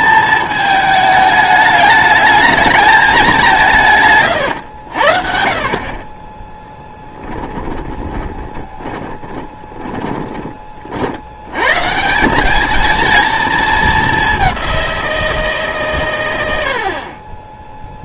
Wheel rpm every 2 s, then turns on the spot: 220, 210, 100, 10, 30, 30, 210, 190, 80.
4-10